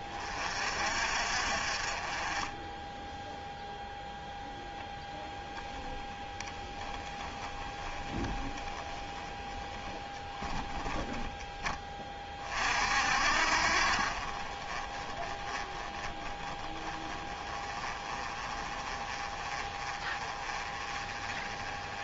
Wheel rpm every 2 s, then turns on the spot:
40, 20, 10, 20, 10, 10, 40, 30, 20, 30, 30.
6-10